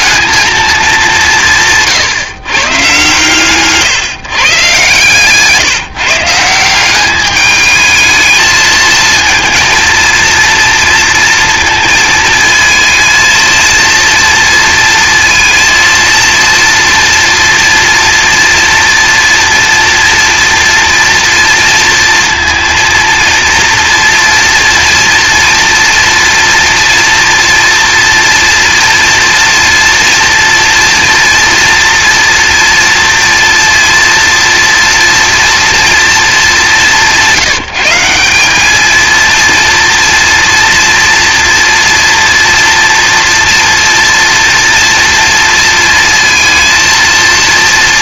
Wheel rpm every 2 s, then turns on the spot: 220, 140, 130, 170, 220, 230, 220, 230, 230, 230, 230, 230, 230, 230, 230, 230, 230, 230, 200, 200, 230, 240, 230, 230.
none